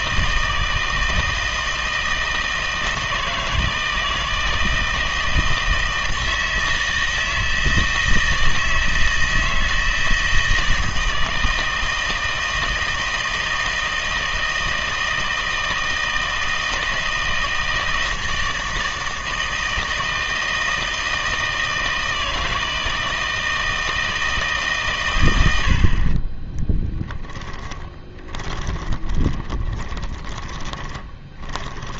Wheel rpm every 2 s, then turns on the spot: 160, 160, 160, 160, 160, 160, 160, 160, 160, 160, 160, 160, 150, 20, 20, 20.
26-32